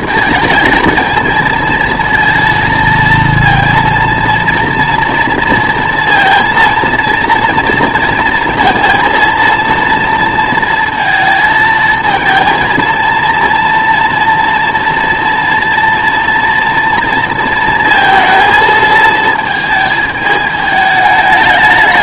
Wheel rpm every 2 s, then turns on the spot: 230, 230, 230, 230, 230, 230, 230, 230, 230, 220, 210.
none